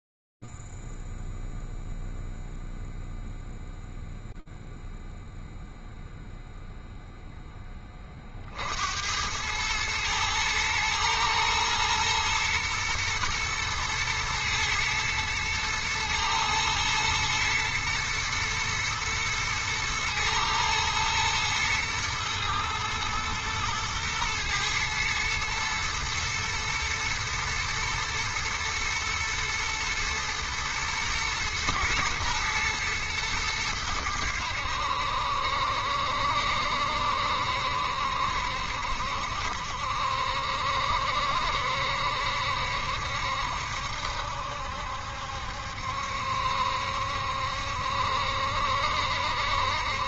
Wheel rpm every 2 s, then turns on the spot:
0, 0, 0, 0, 20, 110, 120, 120, 110, 120, 110, 120, 110, 110, 110, 110, 110, 70, 70, 70, 70, 70, 70, 70, 70.
none